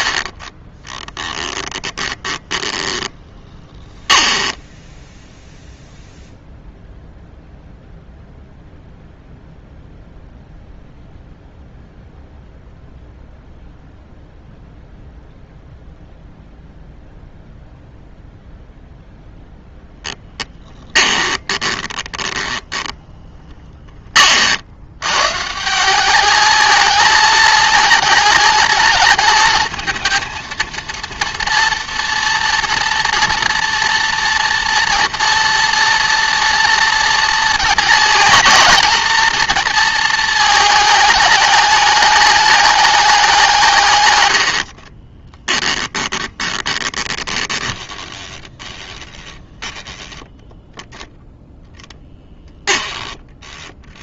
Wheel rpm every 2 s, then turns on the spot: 20, 10, 10, 0, 0, 0, 0, 0, 0, 0, 10, 10, 70, 220, 220, 230, 230, 230, 230, 220, 220, 210, 60, 20, 20, 10, 20.
0-6 20-24 44-54